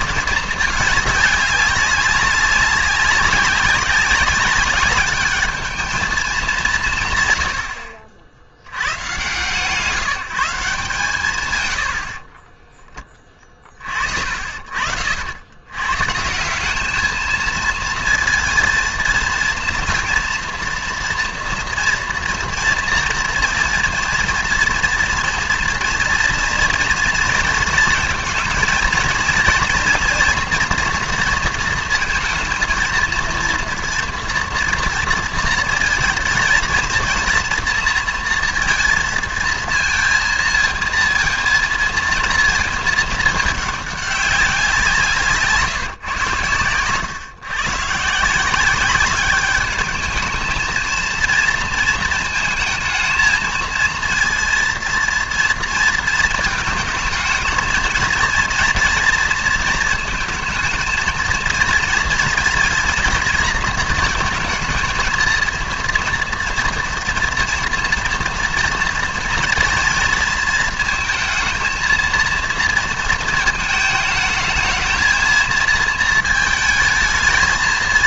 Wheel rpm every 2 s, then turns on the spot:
220, 190, 200, 190, 90, 170, 20, 60, 190, 230, 230, 230, 230, 230, 230, 230, 230, 230, 230, 230, 230, 230, 190, 110, 180, 220, 220, 230, 230, 230, 220, 230, 230, 230, 230, 230, 230, 220, 220.
12-14